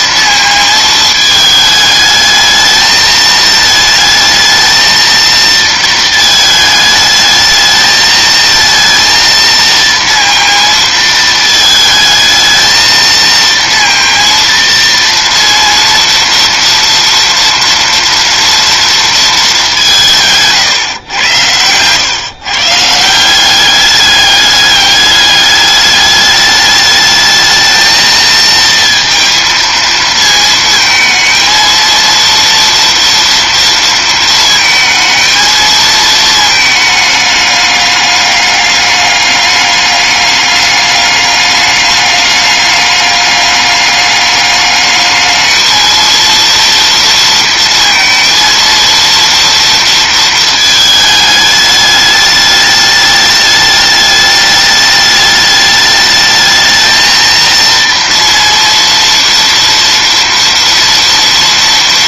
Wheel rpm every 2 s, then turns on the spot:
220, 220, 220, 220, 230, 230, 220, 230, 230, 230, 140, 150, 210, 210, 230, 220, 230, 220, 220, 200, 210, 210, 210, 230, 230, 220, 210, 210, 220, 230, 230.
none